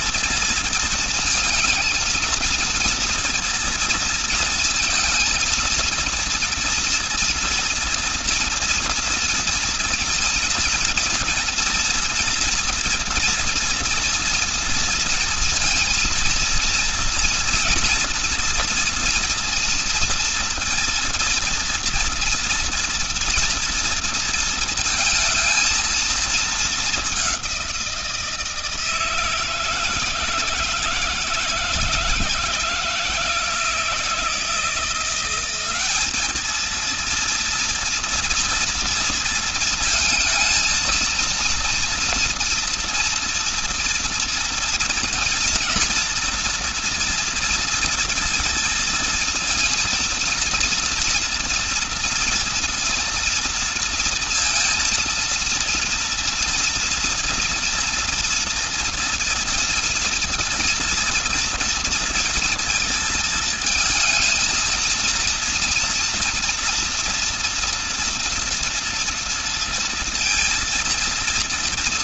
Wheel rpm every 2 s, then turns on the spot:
220, 230, 230, 230, 230, 240, 230, 230, 240, 230, 230, 230, 220, 200, 160, 160, 160, 180, 230, 230, 230, 230, 240, 230, 230, 230, 230, 230, 230, 230, 230, 230, 230, 230, 230, 230.
none